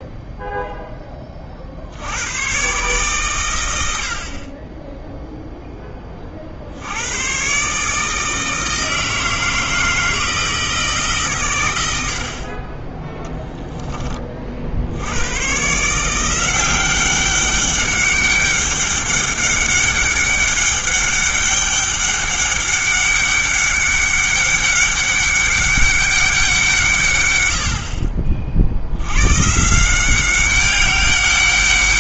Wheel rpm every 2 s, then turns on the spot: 10, 130, 10, 70, 160, 160, 20, 70, 180, 200, 200, 200, 200, 160, 70, 190.
none